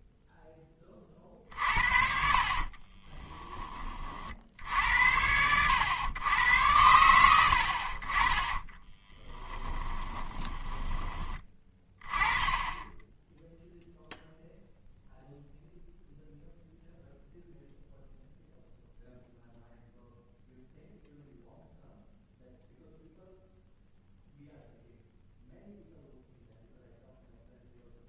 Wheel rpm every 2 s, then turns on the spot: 10, 40, 70, 100, 20, 20, 10, 0, 0, 0, 0, 0, 0, 0.
2-4 8-12